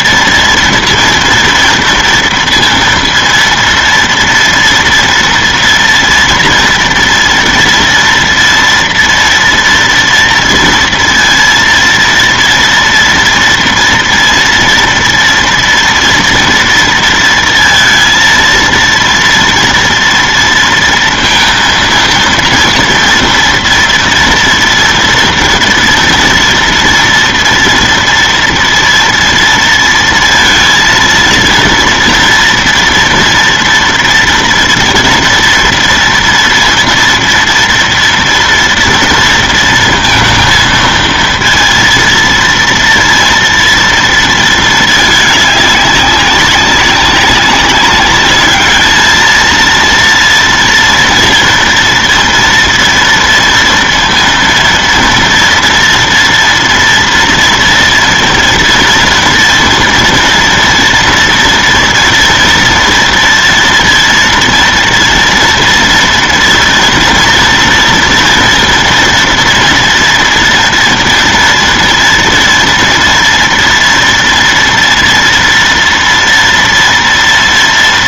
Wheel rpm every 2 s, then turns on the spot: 230, 230, 230, 230, 230, 230, 230, 230, 230, 230, 230, 230, 240, 230, 230, 230, 230, 230, 230, 230, 230, 230, 230, 190, 210, 230, 230, 230, 230, 230, 230, 230, 230, 230, 230, 230, 230, 230, 230.
none